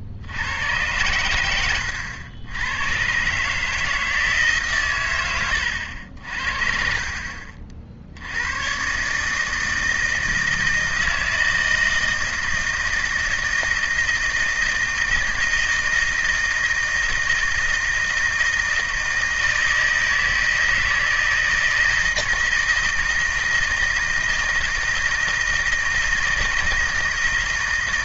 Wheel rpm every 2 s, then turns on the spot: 110, 110, 130, 50, 130, 160, 160, 160, 160, 160, 160, 160, 160, 160.
none